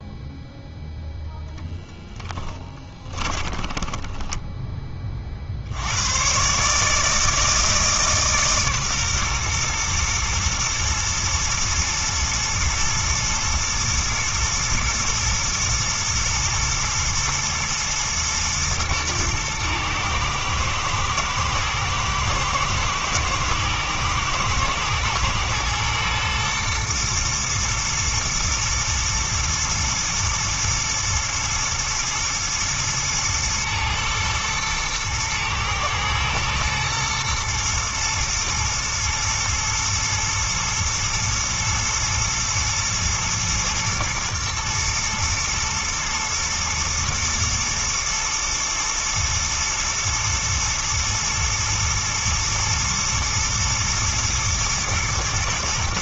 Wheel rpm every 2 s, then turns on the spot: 0, 20, 30, 150, 130, 110, 110, 110, 120, 110, 110, 110, 110, 120, 120, 110, 110, 110, 120, 120, 110, 120, 120, 110, 110, 110, 110, 120.
2-4